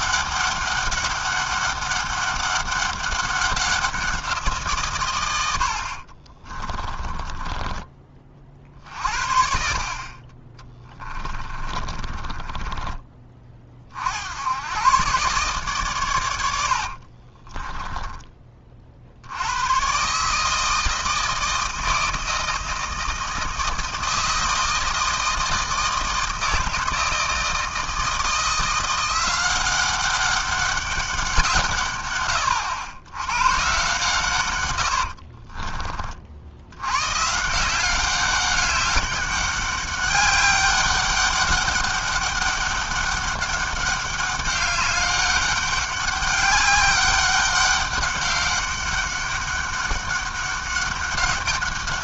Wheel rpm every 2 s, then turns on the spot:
200, 200, 160, 30, 60, 20, 20, 100, 80, 40, 160, 160, 160, 160, 170, 200, 110, 110, 80, 200, 200, 200, 200, 200, 200, 200.
6-8 10-14 16-18